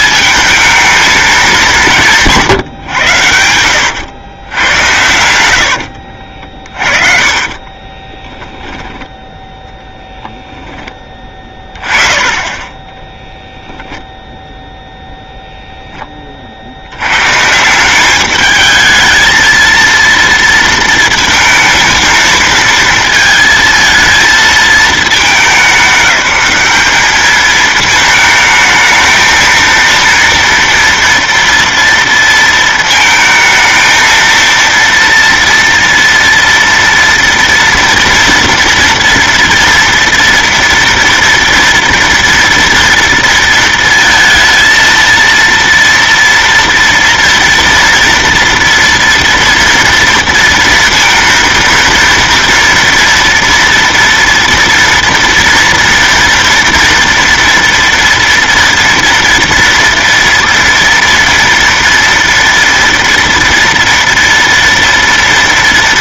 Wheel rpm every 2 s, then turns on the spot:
220, 130, 90, 50, 10, 10, 10, 0, 70, 220, 220, 220, 220, 200, 220, 230, 220, 230, 230, 230, 230, 230, 230, 230, 230, 230, 230, 240, 230, 230, 230, 230, 230.
2-4 6-8